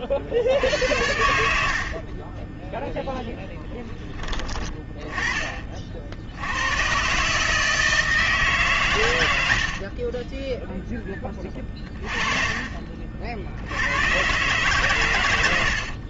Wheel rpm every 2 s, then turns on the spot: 60, 10, 20, 110, 140, 10, 30, 140.
none